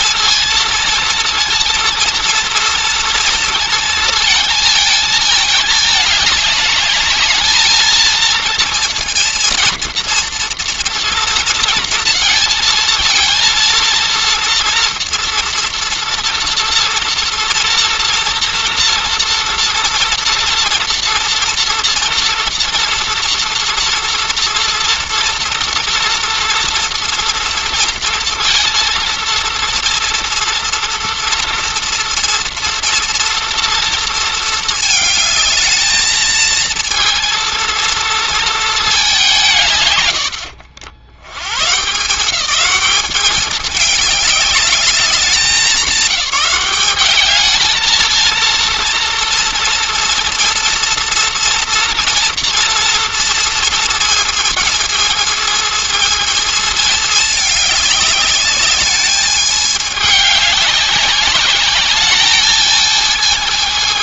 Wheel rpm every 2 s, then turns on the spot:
230, 230, 220, 210, 230, 230, 230, 230, 230, 240, 230, 230, 230, 230, 230, 230, 230, 220, 230, 210, 60, 200, 200, 190, 230, 230, 230, 220, 220, 210, 200, 220.
none